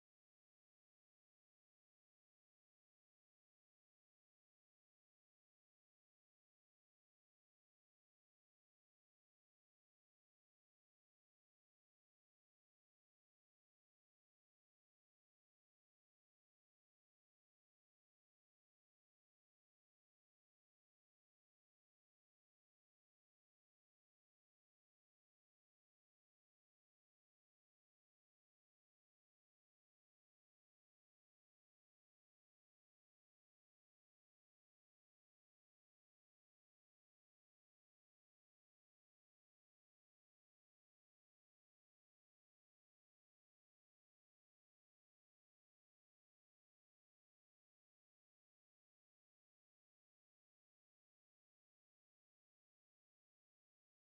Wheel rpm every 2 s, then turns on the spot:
60, 150, 140, 50, 60, 140, 110, 100, 140, 130, 60, 0, 0, 0, 0, 0, 0, 0, 0, 0, 0, 0, 0, 0, 0, 0, 0.
8-10